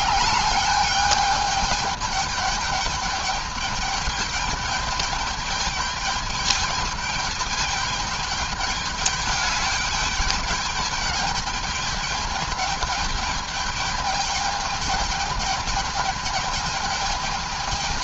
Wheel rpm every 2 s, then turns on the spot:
210, 210, 210, 210, 210, 210, 210, 210, 210.
none